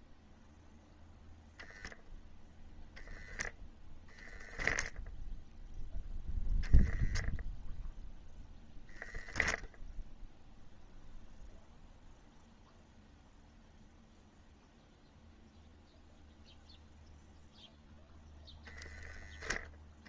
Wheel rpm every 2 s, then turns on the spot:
0, 0, 0, 0, 0, 0, 0, 0, 0, 0.
none